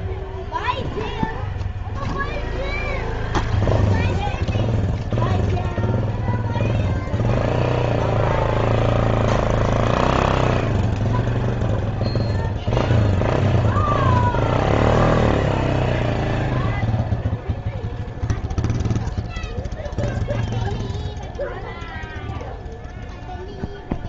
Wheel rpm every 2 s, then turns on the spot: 0, 0, 0, 0, 0, 0, 0, 0, 0, 0, 0, 0.
none